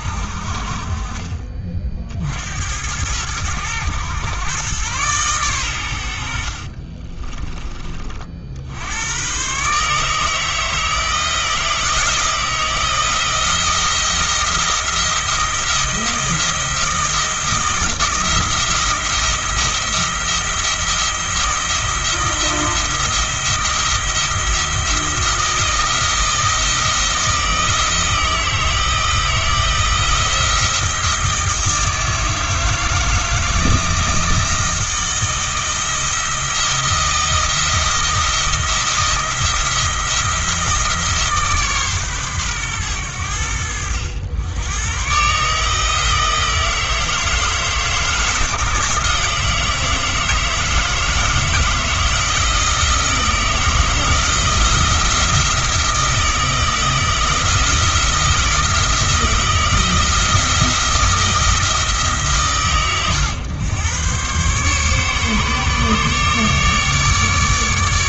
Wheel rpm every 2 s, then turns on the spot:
40, 90, 120, 40, 80, 160, 170, 170, 170, 170, 170, 170, 170, 160, 160, 170, 160, 160, 160, 170, 160, 110, 110, 160, 160, 160, 170, 170, 160, 170, 170, 130, 140, 150.
6-8